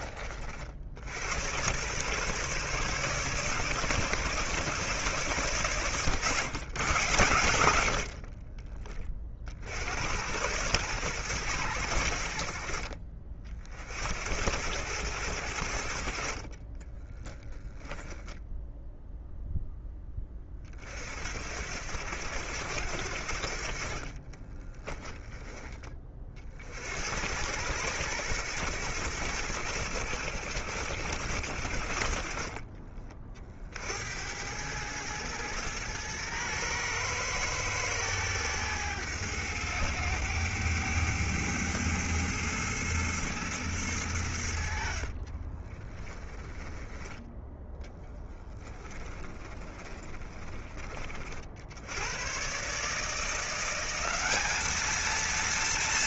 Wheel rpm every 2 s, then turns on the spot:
50, 130, 140, 120, 40, 110, 50, 90, 30, 10, 30, 90, 30, 60, 100, 80, 30, 100, 110, 110, 100, 110, 60, 10, 20, 30, 140, 210.
8-10 16-18 24-26 46-50